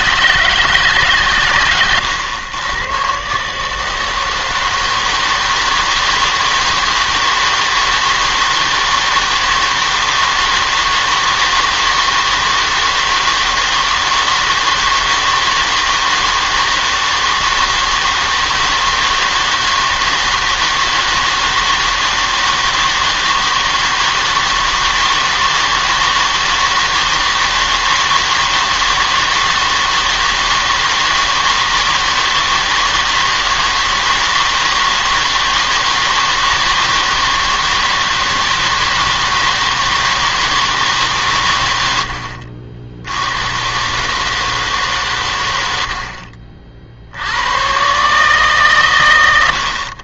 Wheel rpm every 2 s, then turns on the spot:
160, 110, 160, 160, 160, 160, 160, 160, 160, 160, 160, 160, 160, 160, 160, 160, 160, 160, 160, 160, 160, 60, 150, 60, 140.
none